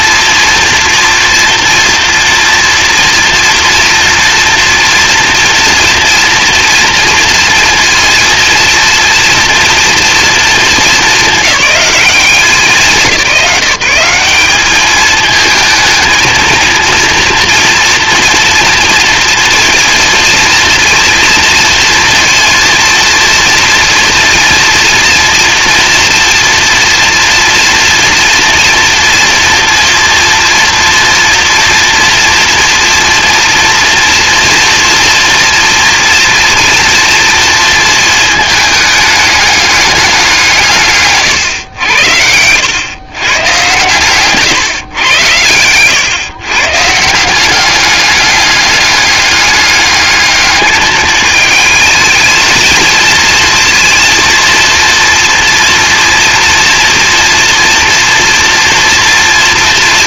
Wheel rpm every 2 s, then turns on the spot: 230, 230, 230, 230, 230, 230, 180, 200, 230, 230, 230, 230, 230, 230, 230, 230, 240, 240, 230, 220, 160, 100, 130, 140, 200, 210, 220, 230, 240, 240.
none